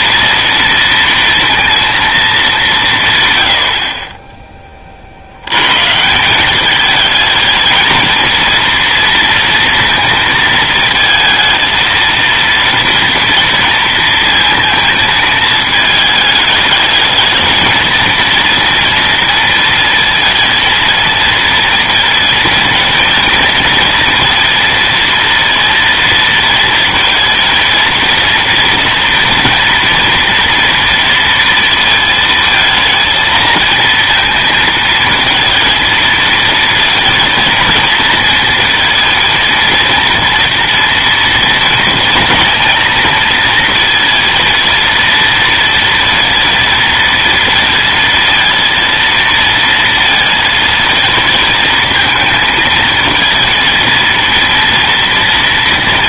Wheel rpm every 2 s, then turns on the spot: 230, 190, 20, 210, 230, 230, 230, 220, 220, 230, 230, 230, 230, 230, 230, 230, 230, 230, 220, 230, 230, 230, 230, 230, 230, 230, 220, 230.
none